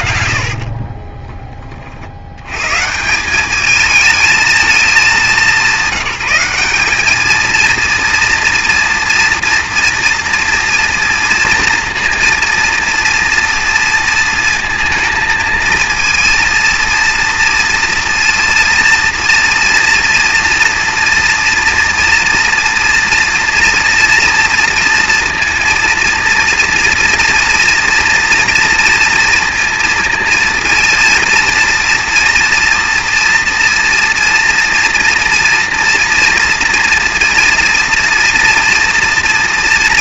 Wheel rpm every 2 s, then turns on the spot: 50, 110, 220, 190, 230, 230, 230, 230, 230, 230, 230, 230, 230, 230, 230, 230, 230, 230, 230, 240.
0-2